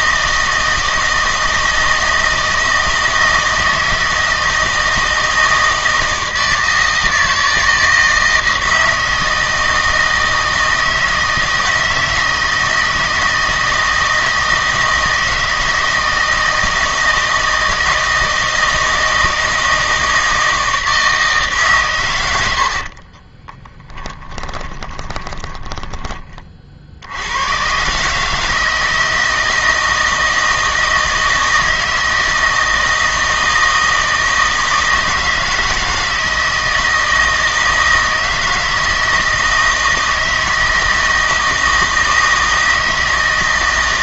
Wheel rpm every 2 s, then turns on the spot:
160, 160, 160, 160, 160, 160, 160, 160, 160, 160, 160, 70, 20, 50, 160, 160, 160, 160, 160, 160, 160, 160.
22-26